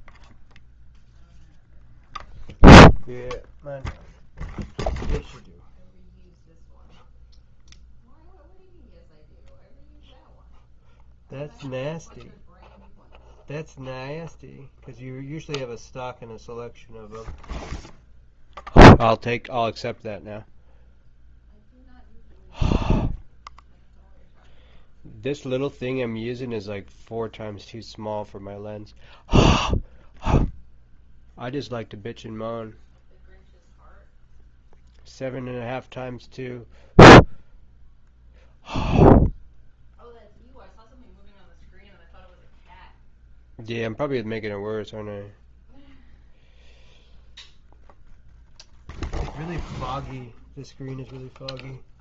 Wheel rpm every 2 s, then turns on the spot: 0, 0, 0, 0, 0, 0, 0, 0, 0, 0, 0, 0, 0, 0, 0, 0, 0, 0, 0, 0, 0, 0, 0, 0, 0, 0.
none